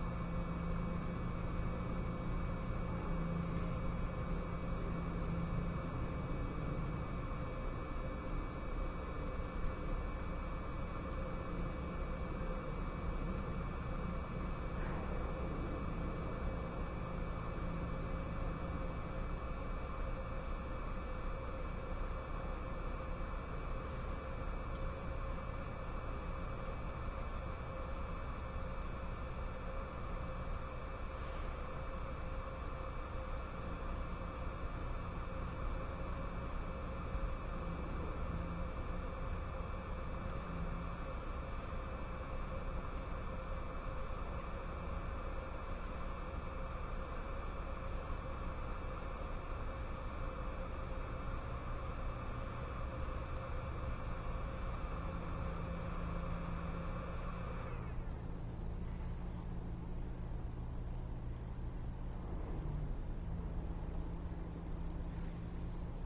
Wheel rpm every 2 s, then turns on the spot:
0, 0, 0, 0, 0, 0, 0, 0, 0, 0, 0, 0, 0, 0, 0, 0, 0, 0, 0, 0, 0, 0, 0, 0, 0, 0, 0, 0, 0, 0, 0, 0, 0.
none